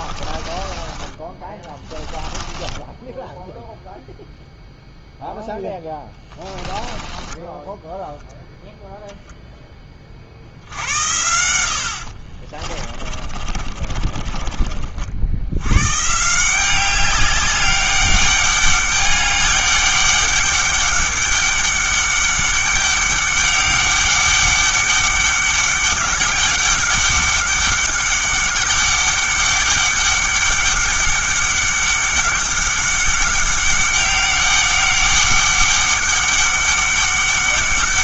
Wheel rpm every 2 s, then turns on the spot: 20, 20, 0, 20, 0, 70, 30, 40, 180, 200, 200, 200, 200, 200, 200, 200, 200, 200, 200.
0-4 6-8 12-14